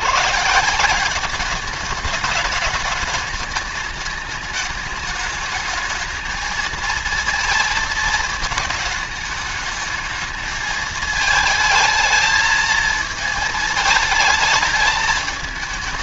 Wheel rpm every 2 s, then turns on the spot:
160, 210, 210, 230, 210, 220, 220, 220.
none